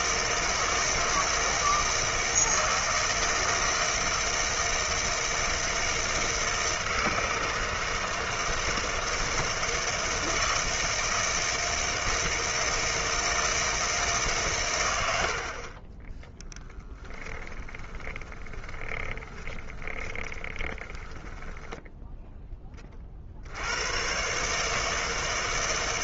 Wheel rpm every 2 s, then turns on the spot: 160, 160, 160, 160, 160, 160, 160, 100, 10, 20, 20, 20, 150.
18-22